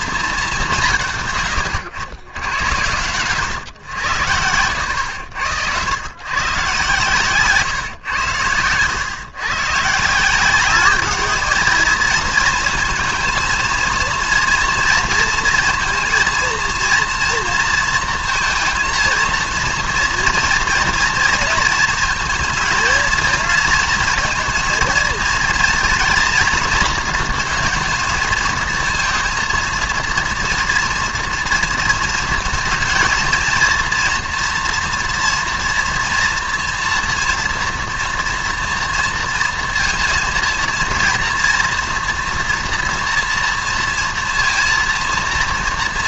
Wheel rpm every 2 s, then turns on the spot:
180, 100, 90, 120, 100, 200, 230, 230, 230, 230, 230, 220, 220, 230, 230, 240, 220, 230, 230, 230, 230, 240, 230.
4-6